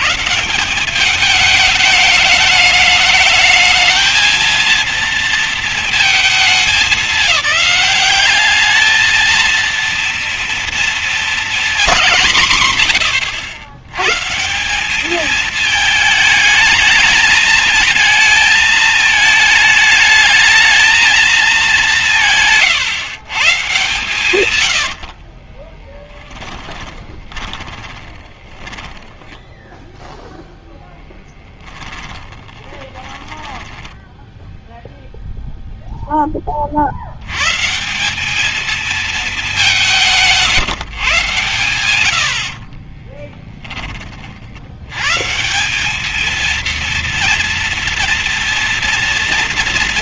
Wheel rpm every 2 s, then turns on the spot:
180, 210, 220, 210, 200, 230, 170, 130, 220, 220, 220, 170, 120, 20, 20, 0, 20, 0, 20, 210, 180, 60, 60, 220, 240.
22-24 26-30 32-34 42-44